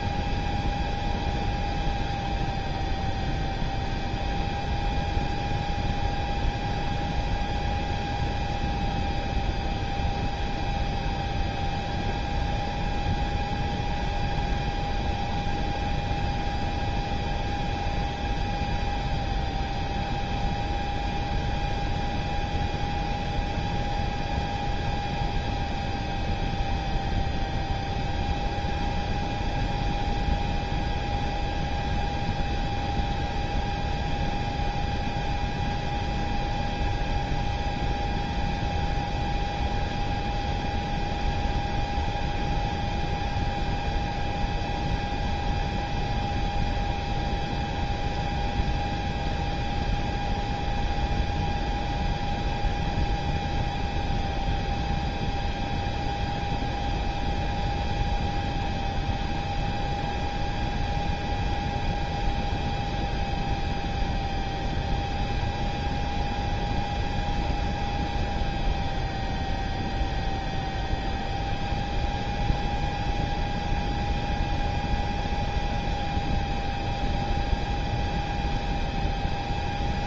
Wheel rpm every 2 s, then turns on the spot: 0, 0, 0, 0, 0, 0, 0, 0, 0, 0, 0, 0, 0, 0, 0, 0, 0, 0, 0, 0, 0, 0, 0, 0, 0, 0, 0, 0, 0, 0, 0, 0, 0, 0, 0, 0, 0, 0, 0, 0.
none